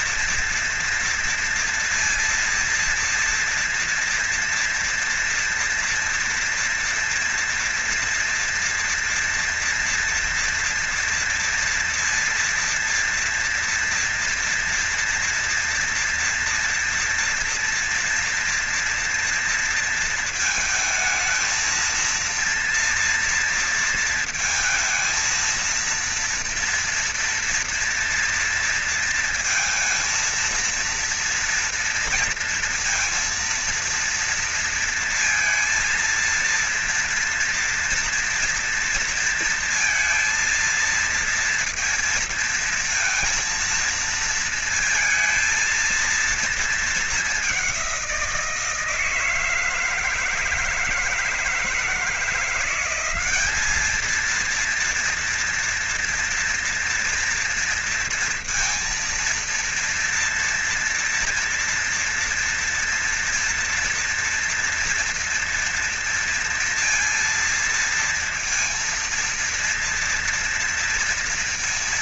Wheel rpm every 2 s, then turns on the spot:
230, 230, 230, 230, 230, 230, 230, 230, 230, 230, 220, 230, 220, 230, 230, 230, 230, 230, 230, 240, 230, 230, 230, 220, 170, 160, 180, 230, 230, 230, 230, 230, 230, 230, 230, 230.
none